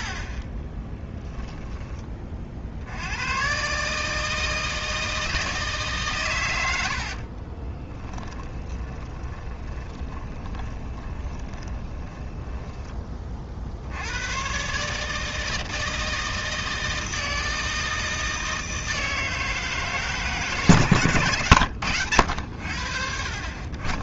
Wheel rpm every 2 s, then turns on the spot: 20, 70, 160, 90, 20, 20, 20, 140, 160, 160, 140, 80.
0-2 6-14